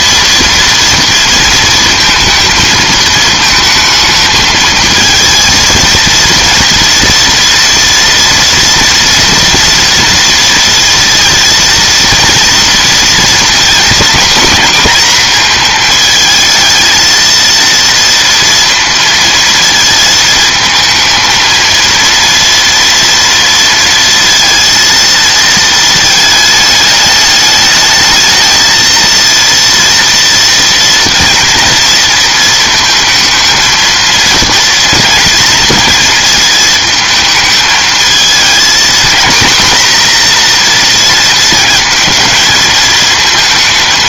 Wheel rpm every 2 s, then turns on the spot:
230, 220, 230, 230, 230, 230, 240, 230, 230, 230, 230, 230, 230, 210, 230, 230, 220, 230, 220, 240, 230, 230.
none